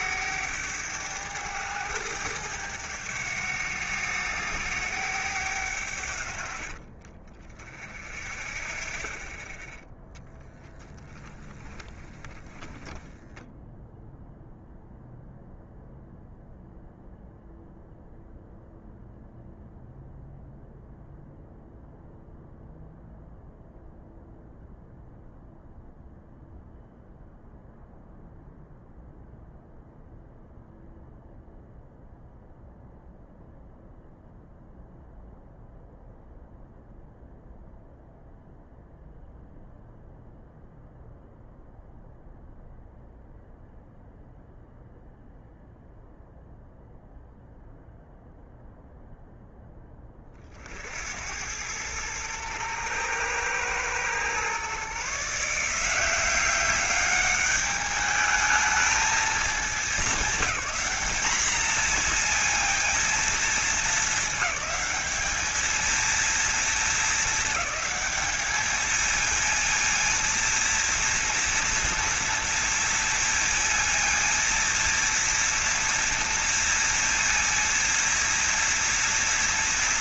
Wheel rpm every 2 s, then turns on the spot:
100, 100, 100, 40, 30, 10, 10, 0, 0, 0, 0, 0, 0, 0, 0, 0, 0, 0, 0, 0, 0, 0, 0, 0, 0, 70, 110, 140, 200, 220, 200, 230, 210, 220, 220, 230, 230, 230, 230, 230.
12-14